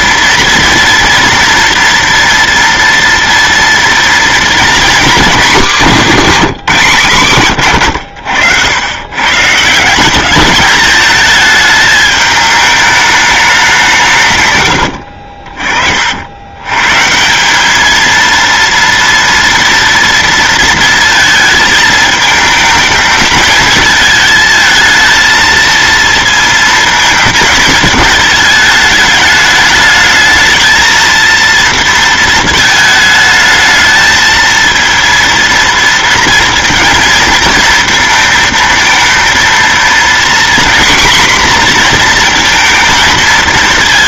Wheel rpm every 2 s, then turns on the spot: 230, 230, 240, 190, 90, 210, 210, 110, 120, 230, 230, 220, 220, 230, 210, 220, 220, 230, 230, 220, 250, 230.
14-16